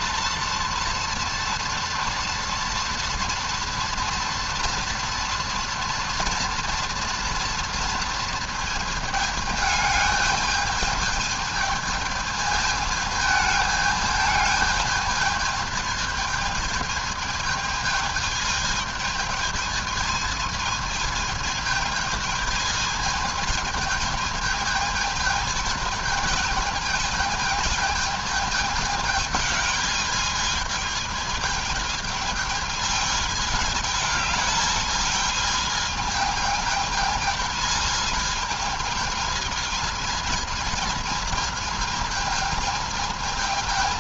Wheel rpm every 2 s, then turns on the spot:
230, 230, 240, 230, 220, 220, 220, 220, 220, 220, 220, 220, 220, 220, 210, 220, 220, 210, 220, 220, 220, 220.
none